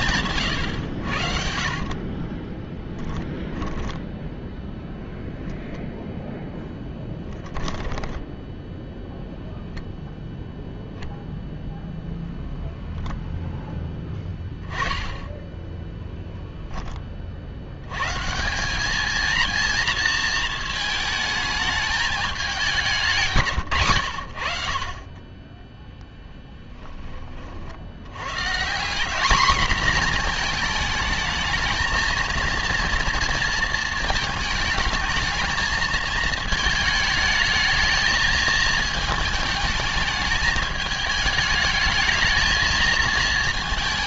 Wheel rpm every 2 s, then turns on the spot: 140, 20, 0, 10, 10, 0, 0, 20, 10, 200, 220, 200, 50, 10, 150, 230, 230, 220, 220, 220, 220, 220.
0-4